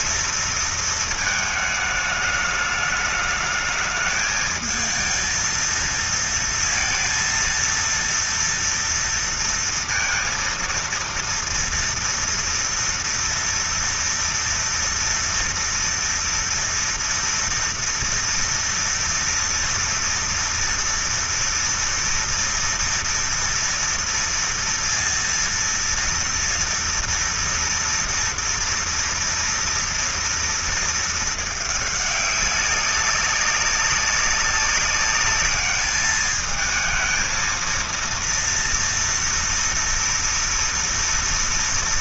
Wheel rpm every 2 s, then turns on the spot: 230, 210, 220, 230, 230, 230, 230, 230, 230, 230, 230, 230, 230, 230, 230, 230, 200, 190, 210, 230, 230.
none